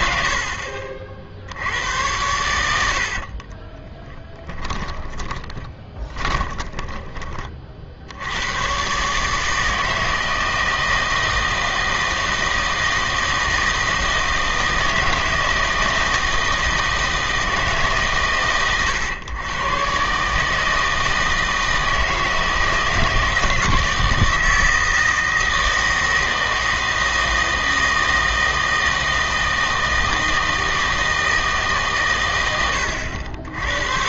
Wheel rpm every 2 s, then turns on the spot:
50, 80, 10, 20, 120, 160, 160, 160, 160, 130, 160, 160, 160, 160, 160, 160, 100.
4-8